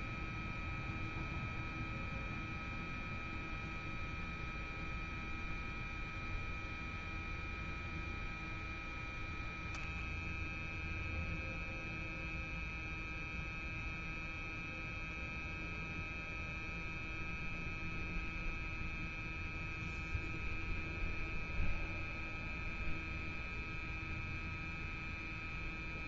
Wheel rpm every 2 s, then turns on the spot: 0, 0, 0, 0, 0, 0, 0, 0, 0, 0, 0, 0, 0.
none